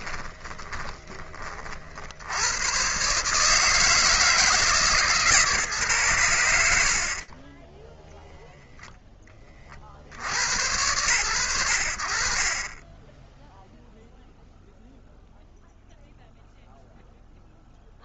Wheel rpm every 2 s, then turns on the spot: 130, 160, 50, 30, 110, 10, 0, 0, 0.
none